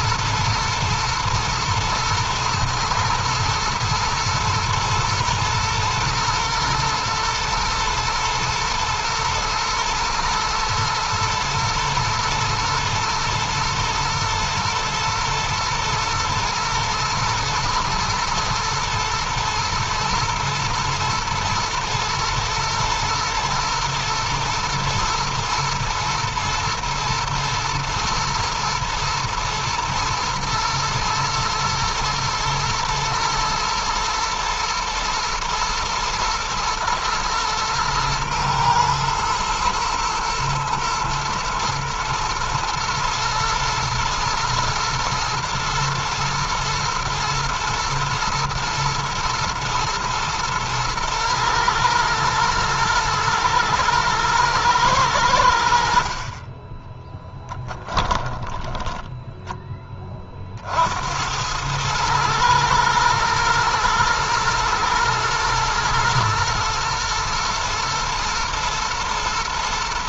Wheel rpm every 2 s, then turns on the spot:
110, 110, 110, 110, 110, 110, 110, 110, 110, 110, 120, 120, 120, 110, 110, 120, 120, 110, 110, 120, 110, 120, 120, 110, 110, 120, 110, 100, 20, 10, 70, 110, 110, 120, 110.
56-60